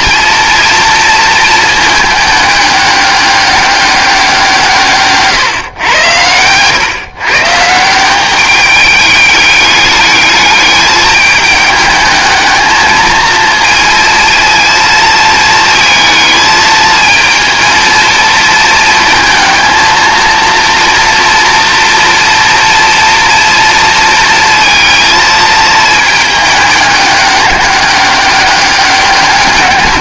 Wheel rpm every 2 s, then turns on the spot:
240, 210, 160, 120, 210, 210, 220, 220, 220, 230, 230, 230, 230, 210, 200.
none